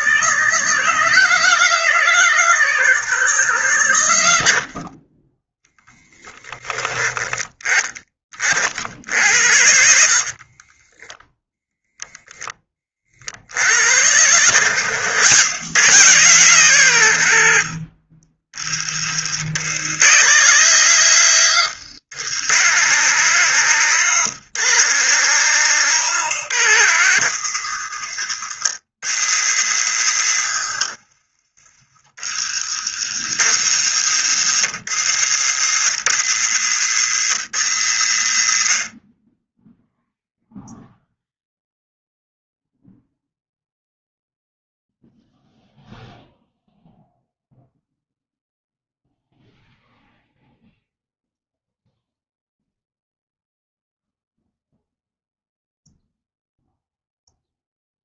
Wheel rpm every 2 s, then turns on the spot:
160, 160, 40, 20, 60, 10, 30, 110, 140, 40, 140, 150, 160, 130, 100, 70, 70, 110, 110, 40, 0, 0, 0, 0, 0, 0, 0, 0, 0.
6-8 10-12